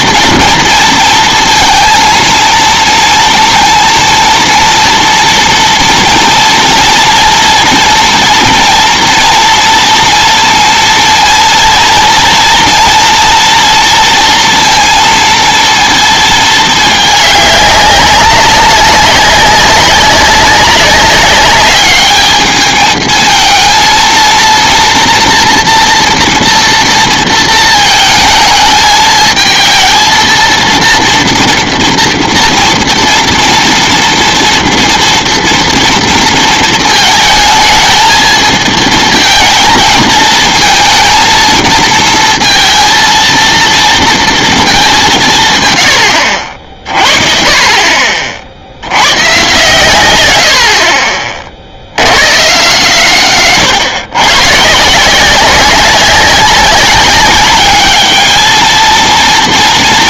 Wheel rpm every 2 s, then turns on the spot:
230, 230, 230, 230, 230, 230, 230, 230, 220, 190, 200, 220, 230, 230, 220, 230, 230, 230, 230, 220, 230, 230, 210, 50, 80, 50, 130, 150, 190, 220.
none